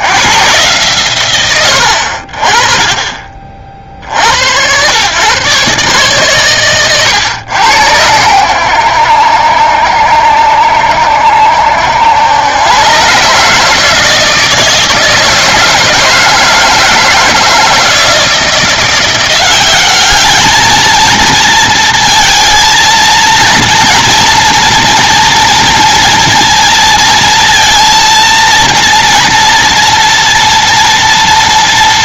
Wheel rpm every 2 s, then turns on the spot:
130, 30, 110, 130, 80, 60, 120, 160, 160, 170, 220, 230, 230, 230, 230, 230.
none